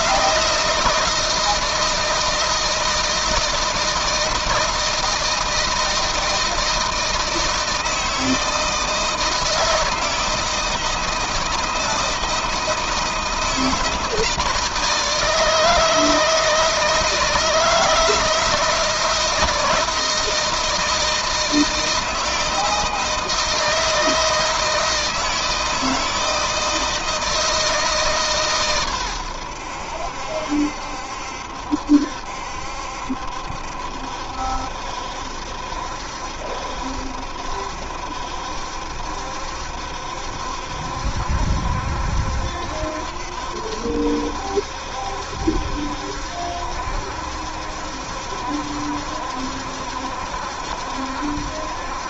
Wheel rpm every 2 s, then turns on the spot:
160, 160, 160, 160, 160, 160, 160, 160, 160, 160, 160, 160, 160, 160, 140, 70, 70, 70, 70, 70, 70, 70, 70, 70, 70, 70.
none